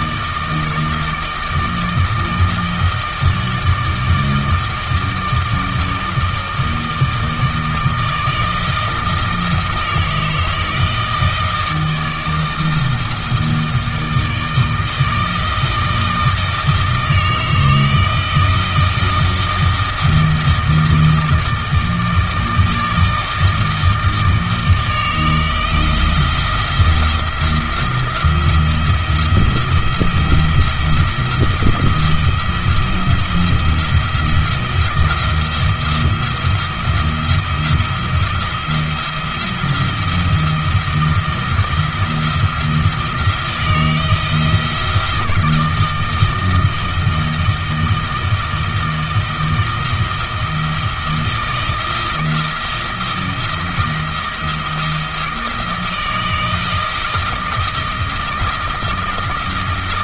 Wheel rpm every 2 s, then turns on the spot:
160, 160, 160, 160, 160, 160, 160, 160, 160, 160, 160, 160, 160, 170, 170, 170, 170, 170, 170, 170, 160, 170, 160, 160, 160, 160, 160, 160, 160, 170.
none